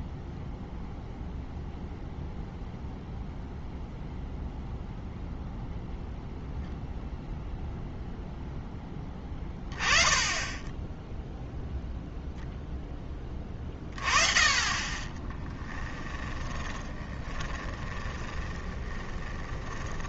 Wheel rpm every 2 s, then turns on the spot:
0, 0, 0, 0, 10, 10, 10, 20, 20, 20.
16-20